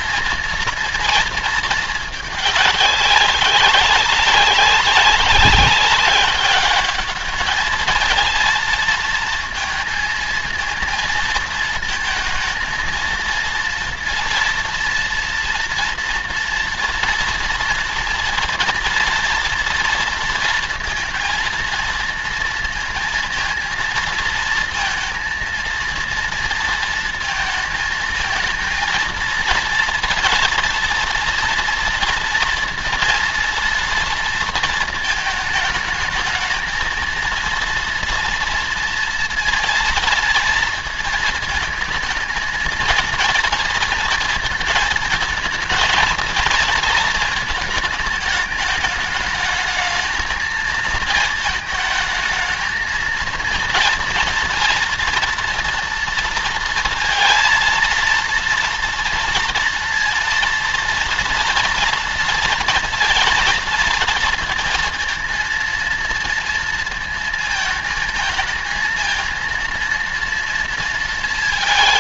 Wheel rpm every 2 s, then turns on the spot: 220, 210, 190, 200, 220, 230, 230, 230, 230, 230, 230, 230, 230, 230, 230, 230, 230, 230, 220, 230, 230, 230, 230, 230, 220, 230, 220, 230, 230, 230, 230, 230, 230, 230, 220, 230.
none